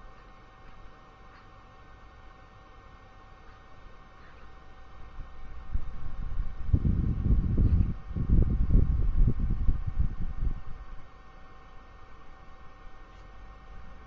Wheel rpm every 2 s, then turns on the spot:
0, 0, 0, 0, 0, 0, 0.
none